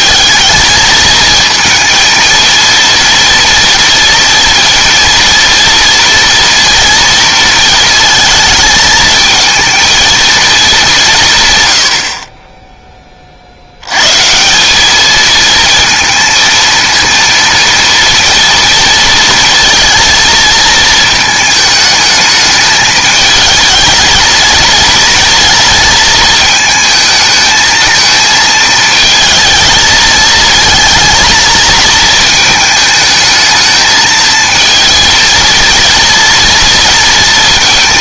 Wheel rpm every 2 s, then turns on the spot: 220, 230, 230, 230, 220, 200, 20, 190, 230, 230, 220, 210, 230, 220, 220, 230, 220, 220, 230.
none